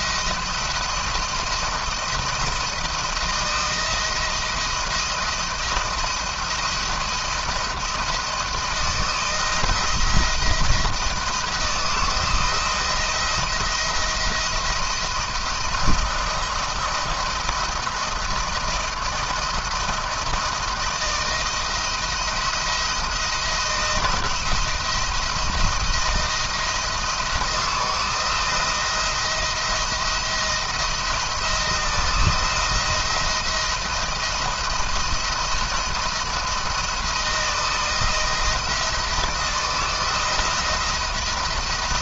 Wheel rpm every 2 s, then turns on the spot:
170, 170, 170, 170, 170, 170, 170, 170, 170, 160, 160, 170, 170, 160, 170, 170, 170, 170, 170, 170, 170.
none